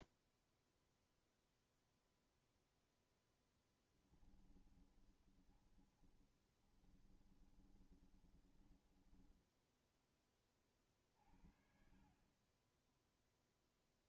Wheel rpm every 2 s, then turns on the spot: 0, 0, 20, 20, 20, 20, 40.
4-10